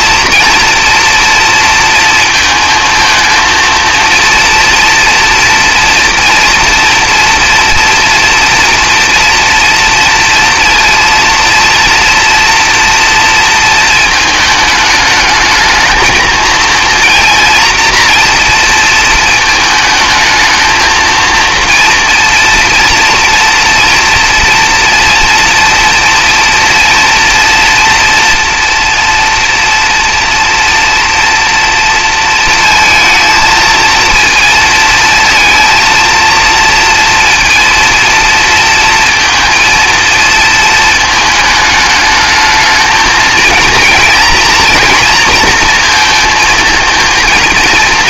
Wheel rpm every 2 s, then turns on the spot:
230, 230, 230, 230, 230, 230, 230, 210, 230, 230, 220, 230, 230, 230, 240, 230, 230, 230, 230, 230, 220, 220, 240, 220.
none